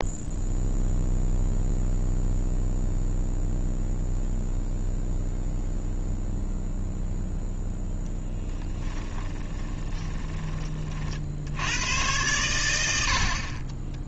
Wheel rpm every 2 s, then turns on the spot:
0, 0, 0, 0, 10, 30, 90.
8-10